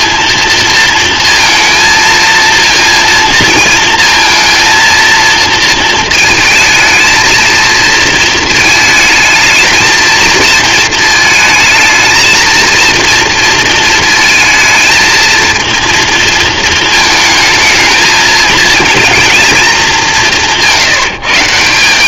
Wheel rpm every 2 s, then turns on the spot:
230, 230, 230, 230, 220, 220, 230, 230, 220, 220, 160.
none